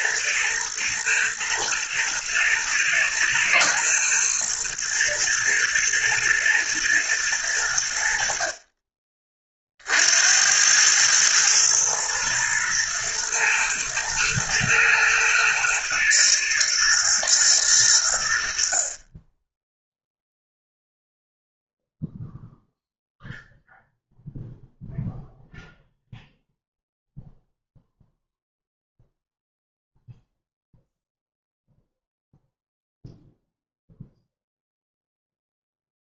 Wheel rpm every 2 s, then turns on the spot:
110, 110, 120, 110, 40, 90, 120, 110, 110, 60, 0, 0, 0, 0, 0, 0, 0, 0.
none